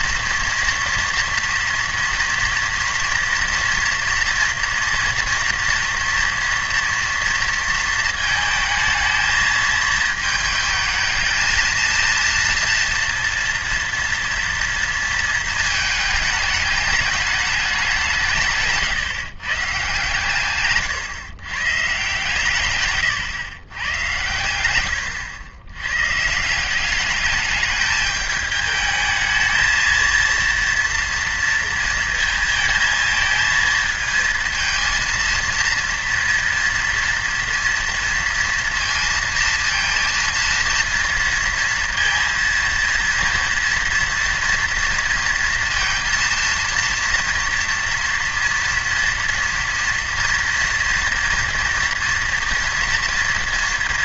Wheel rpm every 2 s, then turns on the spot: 230, 230, 240, 230, 220, 220, 230, 230, 210, 140, 130, 130, 100, 200, 220, 230, 230, 230, 240, 230, 230, 230, 230, 230, 230, 230, 230.
none